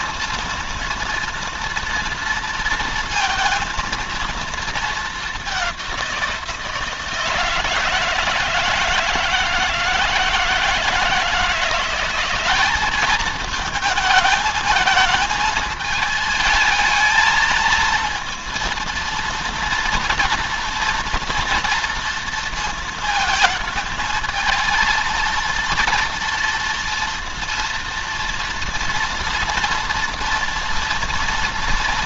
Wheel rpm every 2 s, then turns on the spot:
230, 230, 220, 160, 160, 160, 210, 220, 220, 230, 230, 220, 230, 230, 230, 230.
none